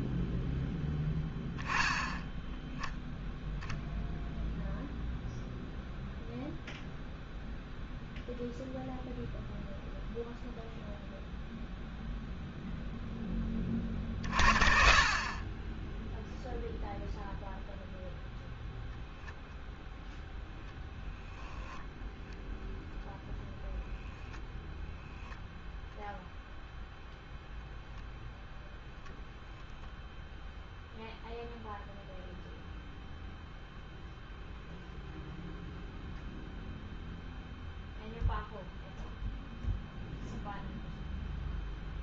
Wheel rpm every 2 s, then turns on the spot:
10, 0, 0, 0, 0, 0, 0, 60, 0, 0, 0, 0, 10, 0, 0, 0, 0, 0, 0, 0, 0.
none